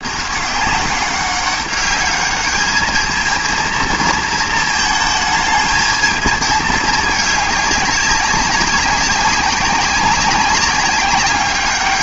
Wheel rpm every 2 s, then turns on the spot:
200, 210, 220, 220, 200, 200.
none